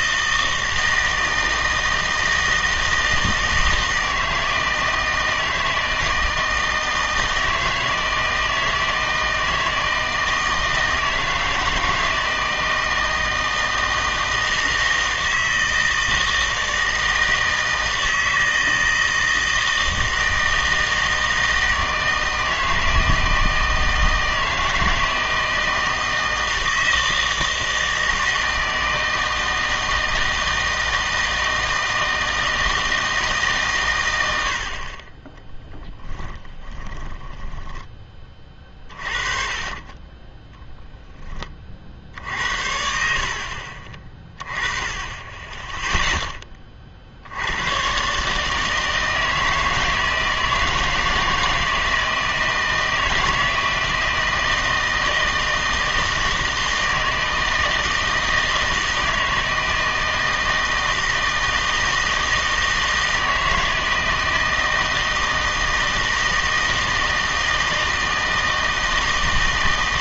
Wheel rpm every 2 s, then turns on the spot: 160, 160, 160, 160, 160, 160, 160, 160, 160, 160, 160, 160, 160, 160, 160, 160, 160, 70, 10, 30, 10, 60, 20, 20, 150, 160, 160, 160, 160, 160, 160, 160, 160, 160, 160.
36-42